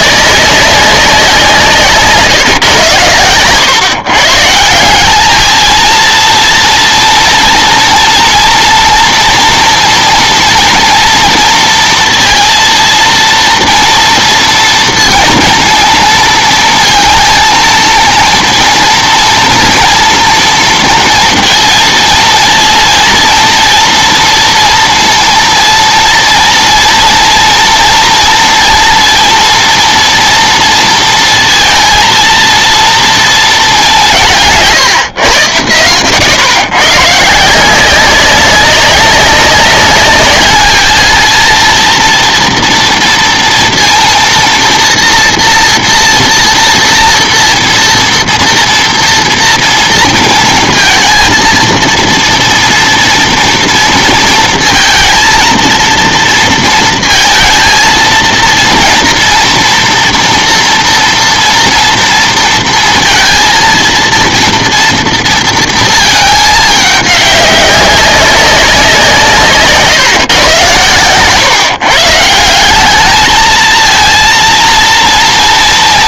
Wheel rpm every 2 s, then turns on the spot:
200, 130, 170, 230, 230, 230, 230, 230, 230, 230, 230, 230, 230, 230, 230, 230, 230, 150, 120, 200, 220, 230, 240, 230, 230, 230, 230, 230, 230, 230, 240, 230, 230, 210, 190, 110, 190, 230.
none